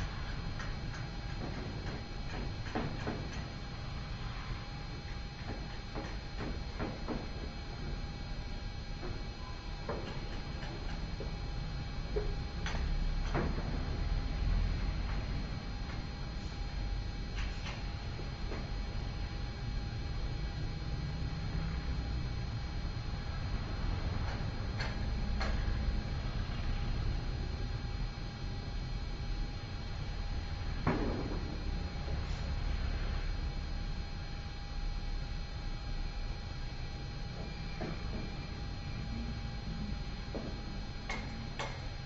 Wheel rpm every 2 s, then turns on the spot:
0, 0, 0, 0, 0, 0, 0, 0, 0, 0, 0, 0, 0, 0, 0, 0, 0, 0, 0, 0, 0.
none